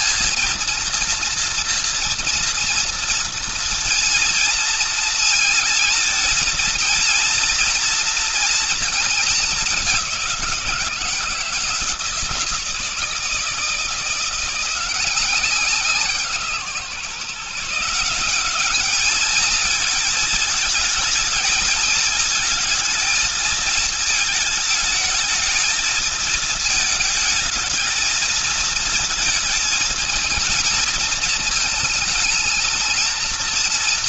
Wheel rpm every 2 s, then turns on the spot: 230, 230, 230, 230, 230, 190, 160, 180, 150, 190, 220, 220, 220, 220, 220, 220, 220.
none